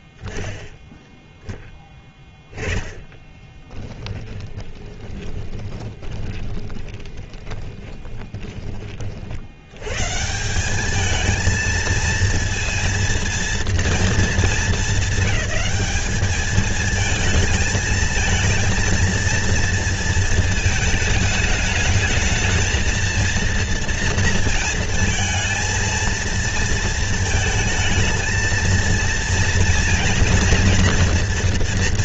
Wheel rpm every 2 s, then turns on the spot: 0, 10, 20, 20, 40, 210, 230, 220, 220, 230, 220, 220, 230, 220, 230, 240.
4-8